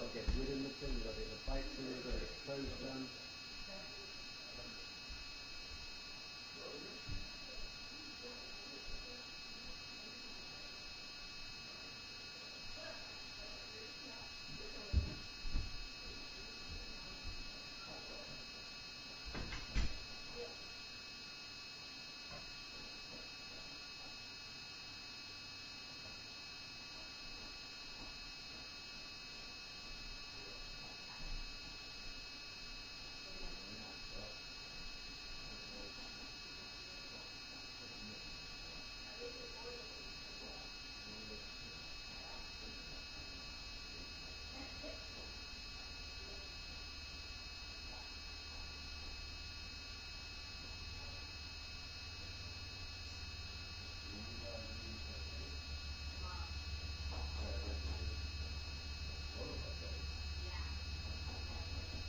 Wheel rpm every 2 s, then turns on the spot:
0, 0, 0, 0, 0, 0, 0, 0, 0, 0, 0, 0, 0, 0, 0, 0, 0, 0, 0, 0, 0, 0, 0, 0, 0, 0, 0, 0, 0, 0, 0.
none